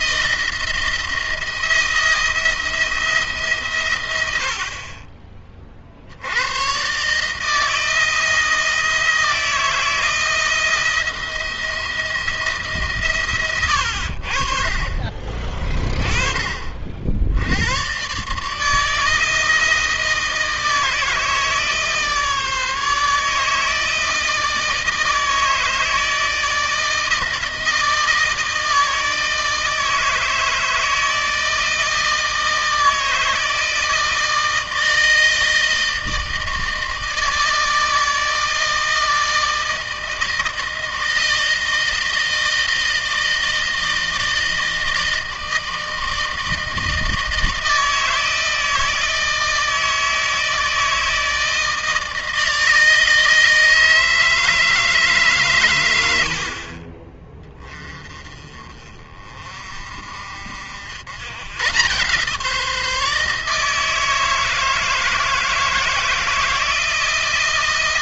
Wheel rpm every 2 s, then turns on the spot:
170, 160, 40, 120, 170, 170, 150, 40, 50, 150, 160, 150, 160, 160, 160, 160, 160, 160, 160, 160, 160, 160, 160, 160, 160, 160, 160, 150, 50, 30, 80, 160, 160, 160.
none